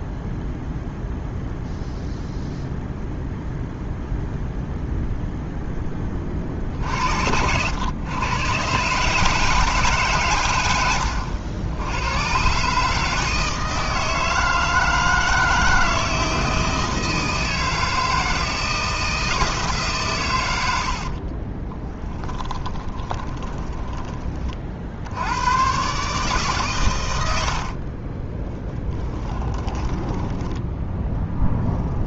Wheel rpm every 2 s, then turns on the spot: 0, 0, 0, 60, 140, 100, 150, 160, 160, 160, 60, 20, 60, 110, 20, 10.
22-24 28-30